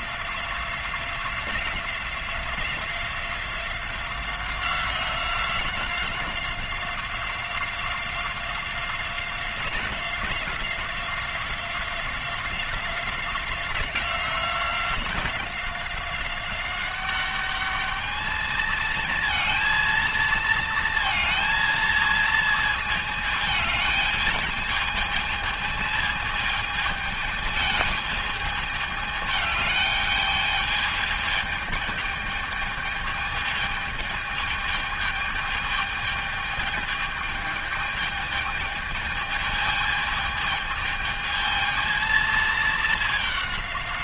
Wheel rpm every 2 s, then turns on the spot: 180, 180, 180, 180, 180, 180, 180, 180, 200, 220, 230, 220, 220, 220, 210, 210, 210, 210, 210, 210, 220, 220.
none